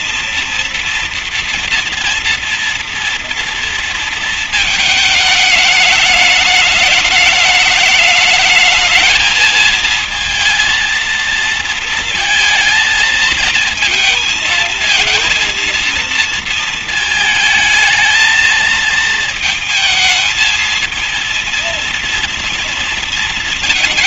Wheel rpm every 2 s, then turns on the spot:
230, 230, 220, 210, 220, 230, 230, 230, 220, 220, 220, 230.
none